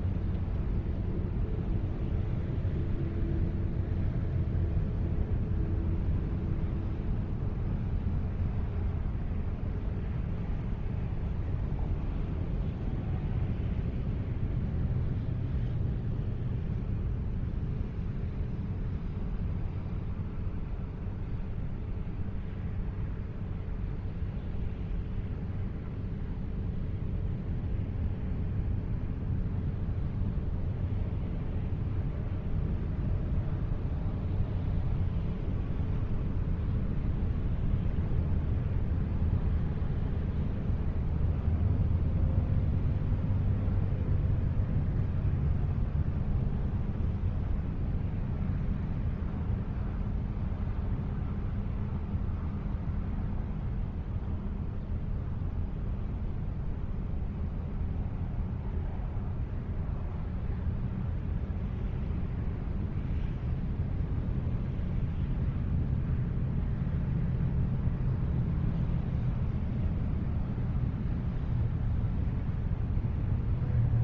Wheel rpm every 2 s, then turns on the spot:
0, 0, 0, 0, 0, 0, 0, 0, 0, 0, 0, 0, 0, 0, 0, 0, 0, 0, 0, 0, 0, 0, 0, 0, 0, 0, 0, 0, 0, 0, 0, 0, 0, 0, 0, 0, 0.
none